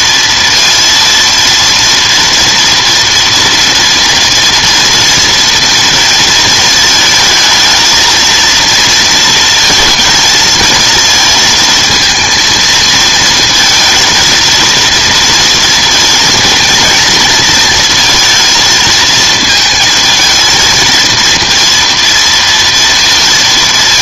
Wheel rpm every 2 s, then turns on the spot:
230, 230, 230, 220, 230, 230, 230, 230, 230, 230, 220, 230.
none